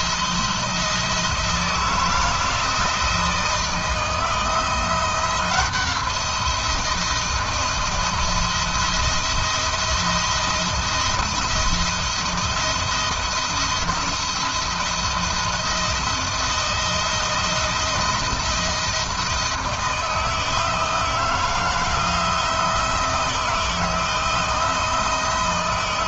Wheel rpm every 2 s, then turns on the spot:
160, 160, 170, 160, 170, 170, 170, 170, 170, 160, 170, 170, 170.
none